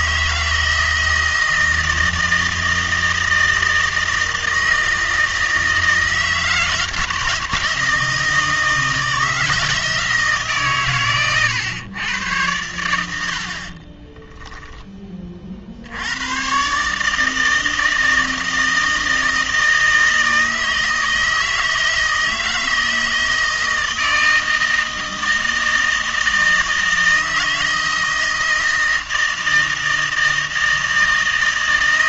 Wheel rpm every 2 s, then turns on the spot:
160, 160, 160, 160, 160, 140, 90, 10, 140, 160, 160, 160, 160, 160, 160, 160.
none